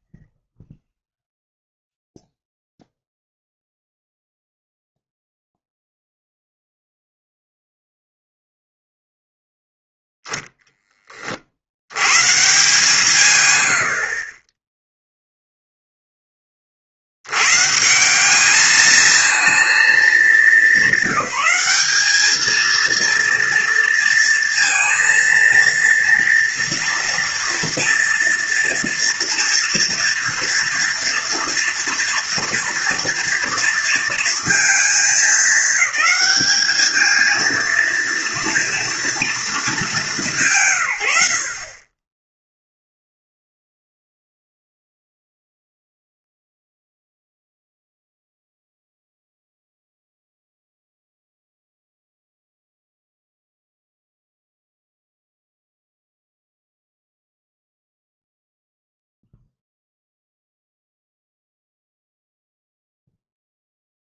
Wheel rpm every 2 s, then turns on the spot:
0, 0, 0, 0, 0, 0, 140, 20, 40, 210, 200, 220, 230, 230, 230, 230, 230, 220, 210, 230, 150, 0, 0, 0, 0, 0, 0, 0, 0, 0, 0, 0.
none